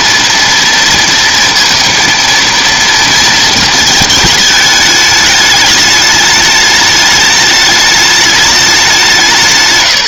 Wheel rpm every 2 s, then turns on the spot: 230, 230, 210, 210, 200.
none